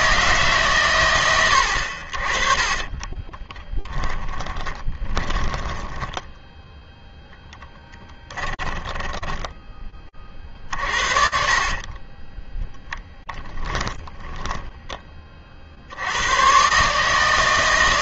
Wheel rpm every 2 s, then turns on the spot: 130, 30, 20, 0, 10, 50, 10, 10, 120.
2-6 8-16